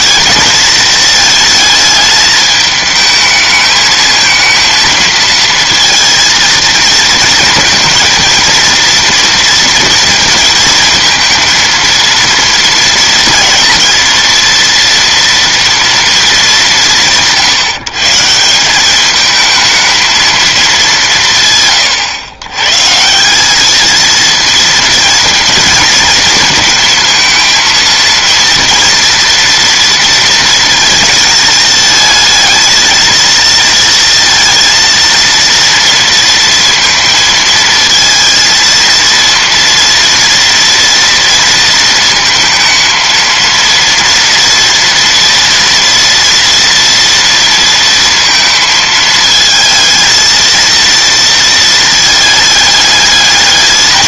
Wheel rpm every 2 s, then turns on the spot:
230, 220, 230, 230, 230, 230, 230, 230, 190, 190, 210, 130, 230, 220, 230, 230, 220, 230, 230, 230, 230, 230, 230, 230, 220, 230, 210.
none